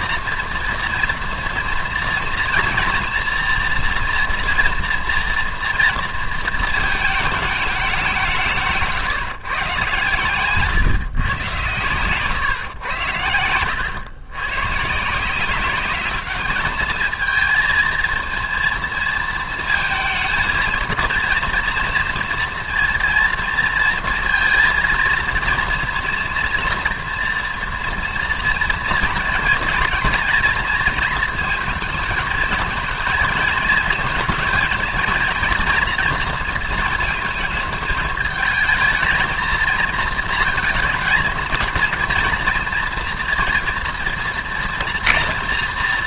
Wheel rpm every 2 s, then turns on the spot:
230, 240, 230, 230, 160, 140, 120, 130, 220, 230, 220, 230, 230, 240, 230, 230, 220, 230, 230, 220, 230, 230, 230.
none